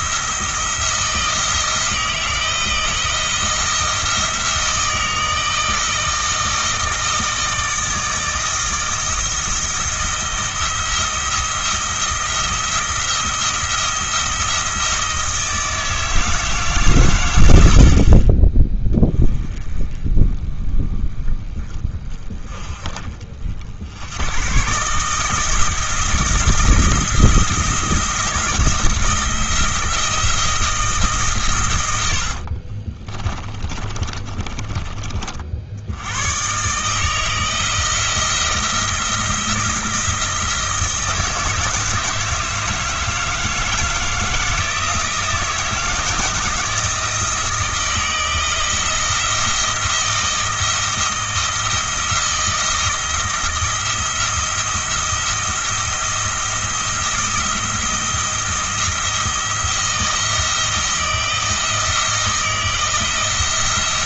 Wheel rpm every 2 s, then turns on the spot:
170, 160, 160, 160, 160, 170, 170, 160, 140, 10, 20, 30, 140, 170, 170, 160, 40, 30, 140, 170, 170, 160, 160, 160, 160, 170, 170, 170, 170, 170, 160, 160.
32-34